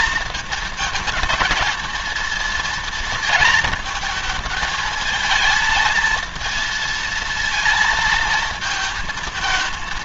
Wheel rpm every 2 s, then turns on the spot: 230, 230, 220, 230, 220.
none